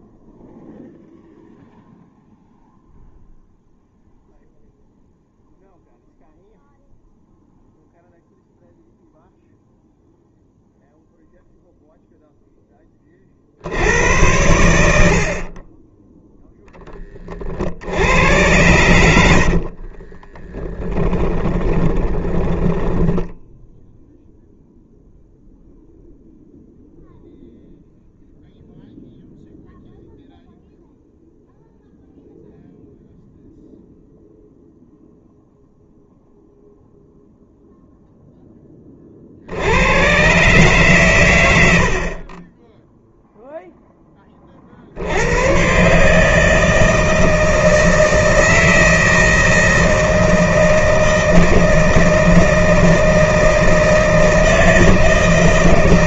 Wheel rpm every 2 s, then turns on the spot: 0, 0, 0, 0, 0, 0, 20, 90, 10, 90, 20, 10, 0, 0, 0, 0, 0, 0, 0, 30, 130, 10, 60, 160, 160, 160, 160, 160.
20-24